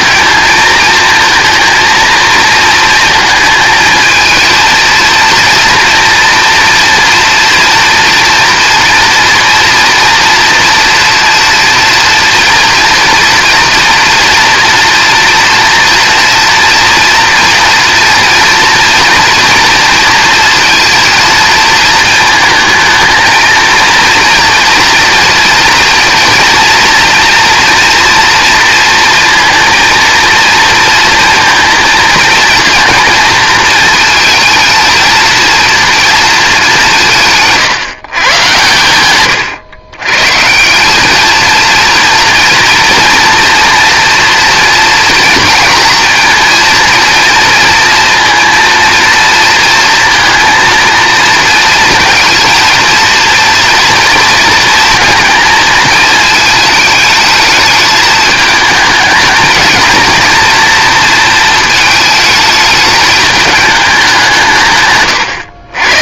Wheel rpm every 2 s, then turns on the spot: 220, 230, 230, 240, 230, 230, 230, 230, 230, 230, 230, 230, 230, 230, 230, 230, 230, 230, 180, 120, 210, 230, 230, 230, 230, 230, 230, 230, 220, 220, 240, 210, 130.
none